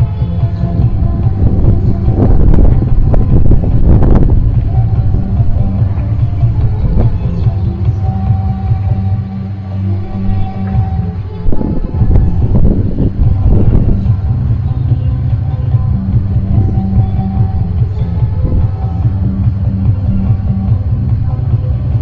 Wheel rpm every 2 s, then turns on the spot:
0, 0, 0, 0, 0, 0, 0, 0, 0, 0, 0.
none